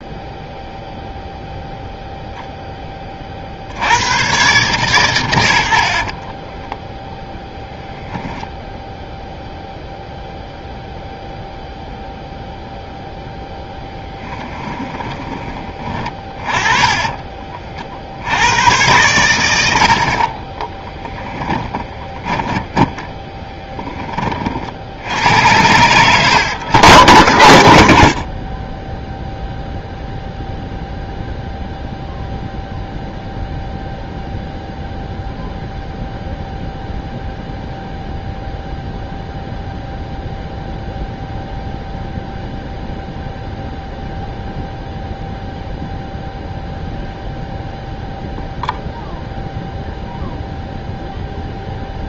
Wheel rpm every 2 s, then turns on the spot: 0, 0, 120, 20, 10, 0, 0, 20, 20, 90, 40, 20, 20, 110, 50, 0, 0, 0, 0, 0, 0, 0, 0, 0, 0, 0.
6-10 14-18 20-24